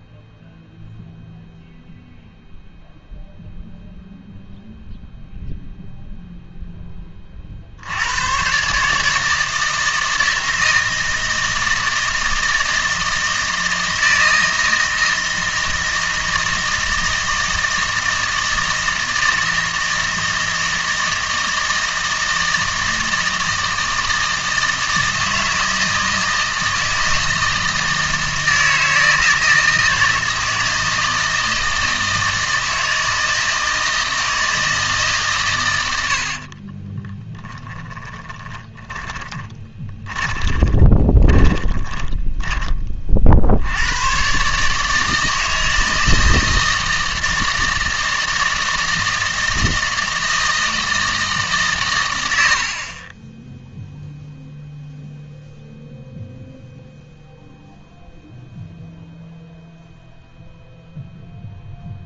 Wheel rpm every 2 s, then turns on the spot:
0, 0, 0, 0, 130, 160, 160, 160, 160, 160, 160, 160, 160, 160, 160, 160, 160, 160, 40, 20, 30, 20, 140, 160, 160, 160, 70, 0, 0, 0, 0.
36-42